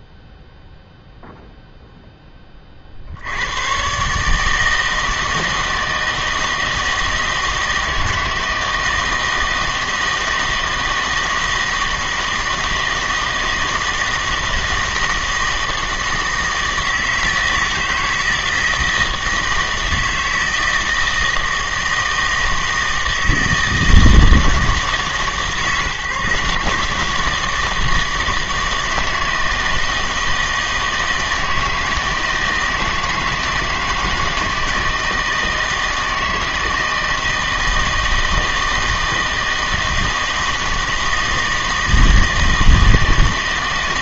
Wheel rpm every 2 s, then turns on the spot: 0, 30, 160, 160, 160, 160, 160, 160, 160, 160, 160, 160, 150, 150, 160, 160, 160, 160, 160, 160, 160, 160.
none